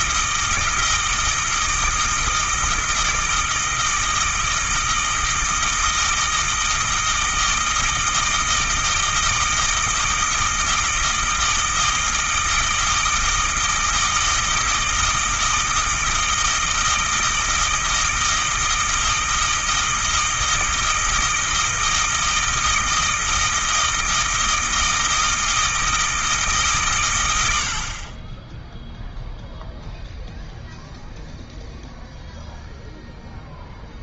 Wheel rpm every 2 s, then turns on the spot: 160, 160, 160, 160, 160, 160, 160, 160, 160, 160, 160, 160, 160, 140, 0, 0, 0.
none